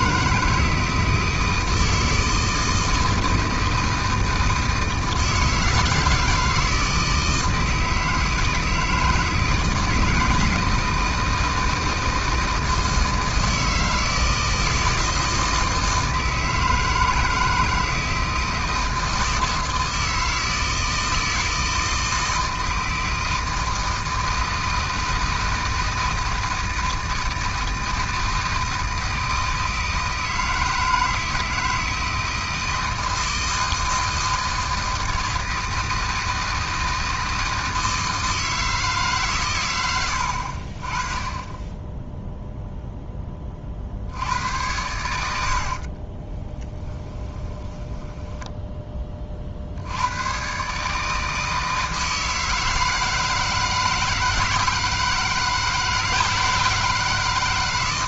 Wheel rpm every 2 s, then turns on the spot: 160, 160, 160, 160, 160, 160, 160, 160, 160, 160, 160, 160, 160, 160, 160, 160, 160, 160, 160, 150, 40, 0, 90, 20, 20, 140, 160, 160, 160.
46-48